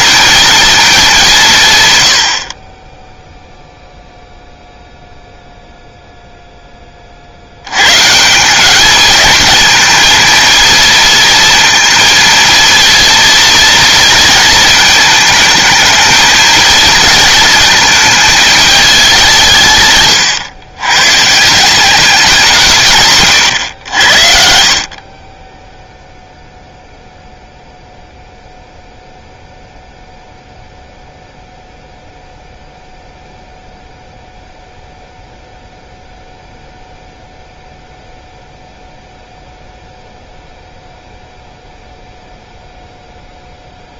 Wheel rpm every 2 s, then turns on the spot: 230, 40, 0, 10, 200, 230, 230, 230, 230, 210, 110, 150, 60, 0, 0, 0, 0, 0, 0, 0, 0, 0.
none